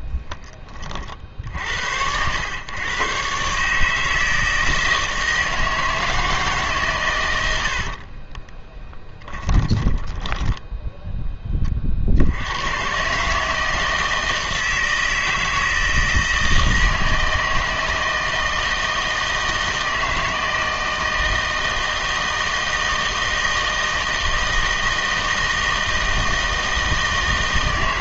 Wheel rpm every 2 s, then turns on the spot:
30, 110, 160, 150, 20, 10, 110, 160, 160, 160, 160, 160, 160, 160.
8-10